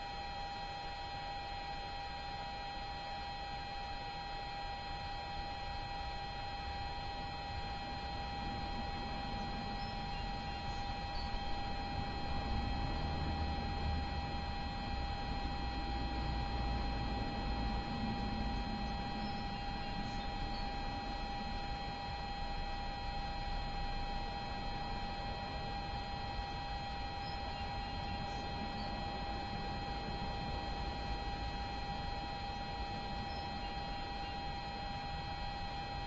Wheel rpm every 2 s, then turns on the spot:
0, 0, 0, 0, 0, 0, 0, 0, 0, 0, 0, 0, 0, 0, 0, 0, 0, 0.
none